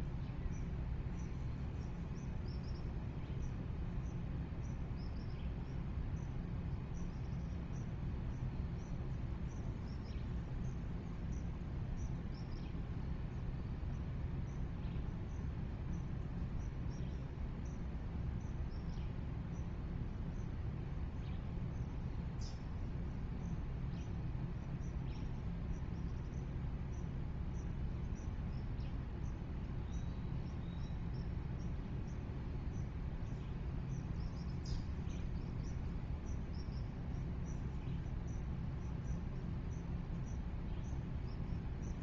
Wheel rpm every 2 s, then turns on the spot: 0, 0, 0, 0, 0, 0, 0, 0, 0, 0, 0, 0, 0, 0, 0, 0, 0, 0, 0, 0, 0.
none